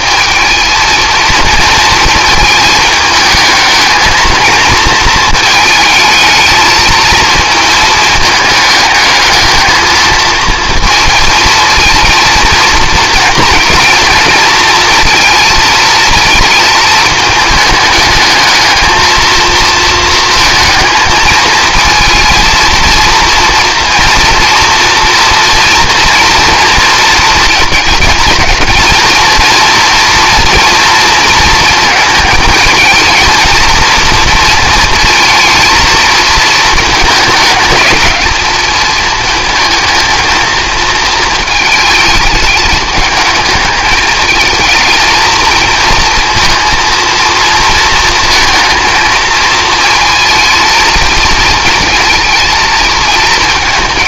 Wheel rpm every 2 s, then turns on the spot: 220, 220, 220, 220, 210, 220, 230, 230, 220, 220, 220, 230, 230, 230, 230, 230, 220, 230, 220, 220, 220, 210, 220, 230, 220, 220, 220.
none